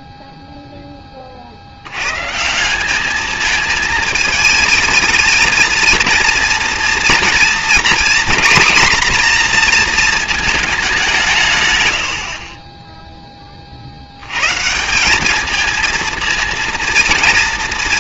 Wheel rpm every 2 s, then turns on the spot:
10, 150, 220, 230, 250, 220, 40, 150, 230.
none